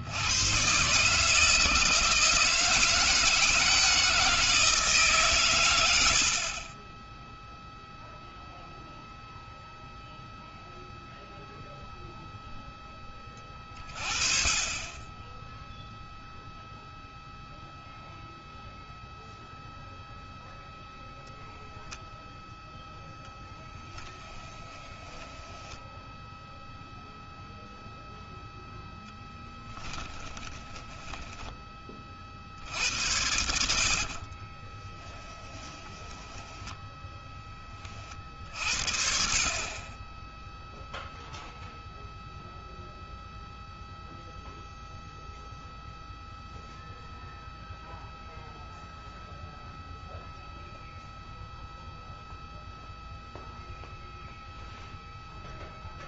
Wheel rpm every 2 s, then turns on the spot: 160, 160, 120, 0, 0, 0, 10, 10, 0, 0, 0, 0, 10, 0, 0, 10, 80, 20, 10, 60, 0, 0, 0, 0, 0, 0, 0, 0.
24-26 30-32 34-36